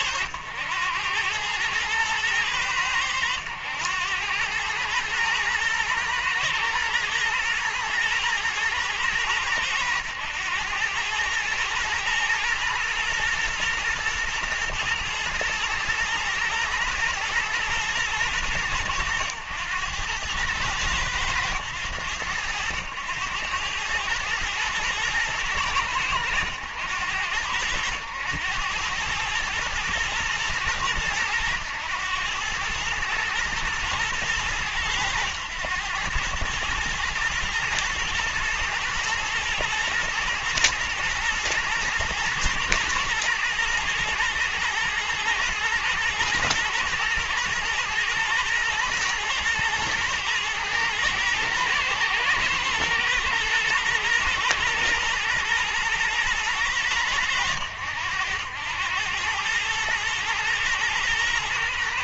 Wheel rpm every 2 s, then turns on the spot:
90, 100, 110, 120, 110, 110, 120, 110, 120, 100, 100, 100, 110, 90, 100, 110, 110, 110, 110, 110, 110, 110, 110, 110, 110, 110, 120, 120, 110, 100, 120.
none